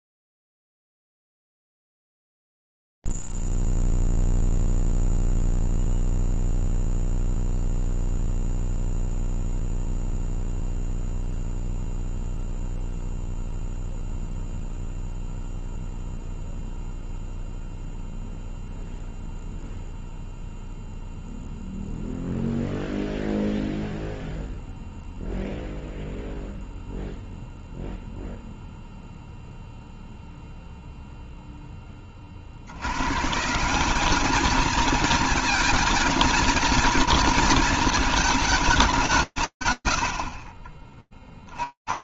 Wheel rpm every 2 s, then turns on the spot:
0, 0, 0, 0, 0, 0, 0, 0, 0, 0, 0, 0, 0, 0, 0, 0, 110, 220, 230, 100, 80.
none